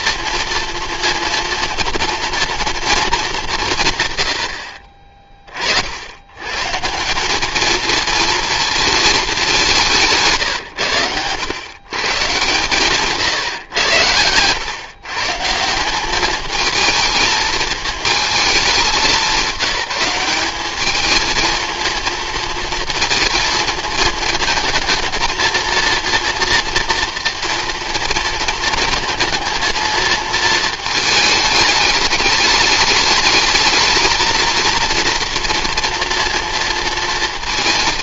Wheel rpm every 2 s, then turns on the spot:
230, 220, 40, 150, 230, 110, 140, 120, 220, 210, 210, 230, 230, 230, 230, 220, 210, 230, 230.
none